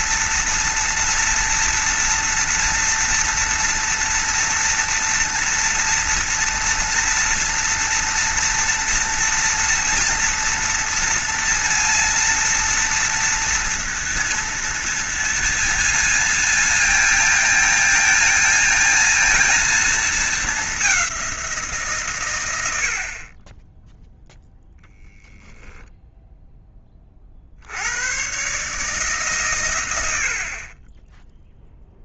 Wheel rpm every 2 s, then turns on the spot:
230, 230, 230, 230, 230, 240, 230, 230, 230, 220, 200, 80, 0, 20, 150, 40.
none